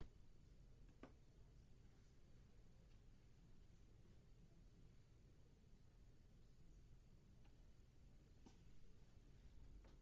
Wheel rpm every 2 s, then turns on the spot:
0, 0, 0, 0, 0.
none